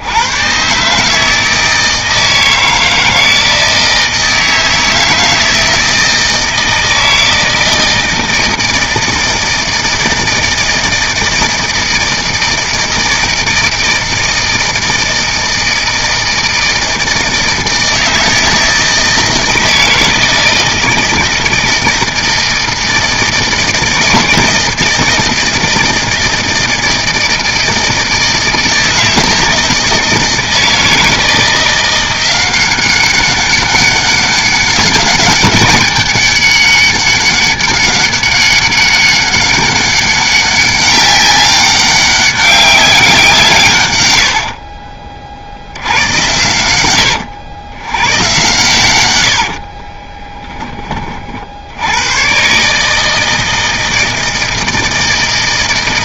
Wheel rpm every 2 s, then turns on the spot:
140, 160, 160, 160, 160, 160, 160, 160, 160, 160, 160, 160, 160, 160, 160, 160, 190, 200, 200, 200, 200, 190, 50, 100, 100, 20, 150, 160.
44-46